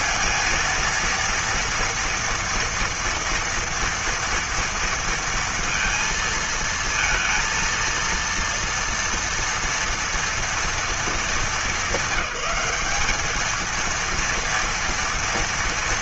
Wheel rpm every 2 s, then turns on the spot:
230, 230, 230, 220, 230, 230, 210, 230.
none